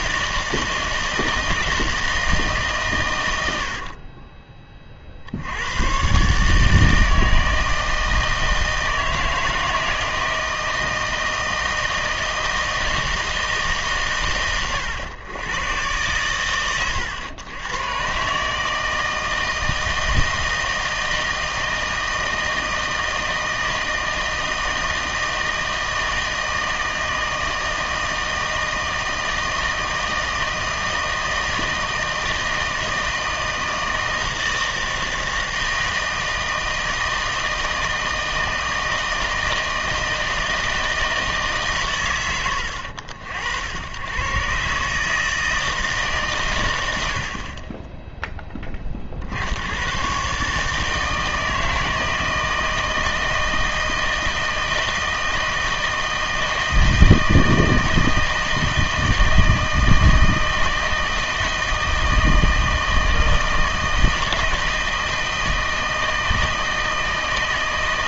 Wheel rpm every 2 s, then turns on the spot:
160, 140, 30, 150, 160, 160, 160, 110, 110, 150, 160, 160, 160, 160, 160, 160, 160, 160, 160, 160, 160, 80, 130, 100, 20, 150, 160, 160, 160, 160, 160, 160, 160, 160.
none